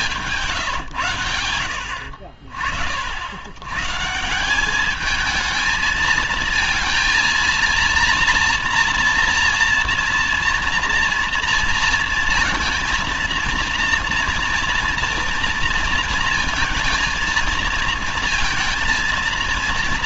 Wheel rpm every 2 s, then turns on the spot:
160, 70, 170, 230, 230, 230, 230, 230, 230, 230.
none